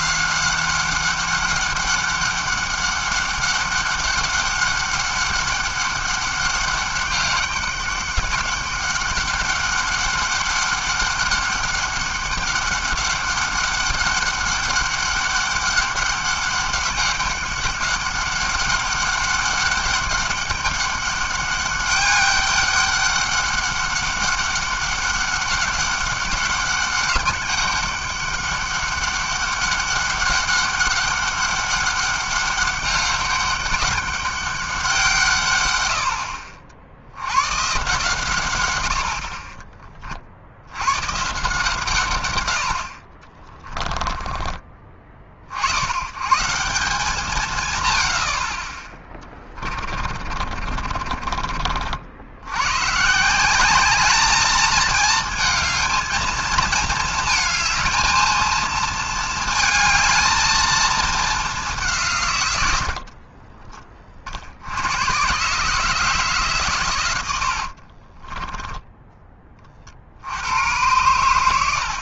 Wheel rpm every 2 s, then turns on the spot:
190, 200, 200, 200, 200, 200, 200, 200, 200, 200, 200, 200, 200, 200, 200, 200, 200, 200, 60, 120, 70, 90, 30, 160, 60, 50, 100, 220, 220, 230, 220, 110, 60, 140, 20, 90.
50-52 68-70